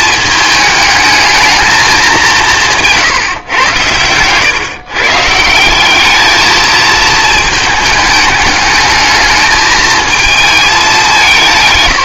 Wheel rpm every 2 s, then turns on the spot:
220, 190, 120, 210, 210, 220.
none